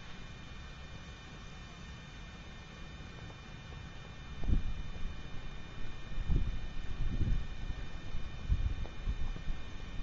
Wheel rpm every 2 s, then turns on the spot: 0, 0, 0, 0, 0.
none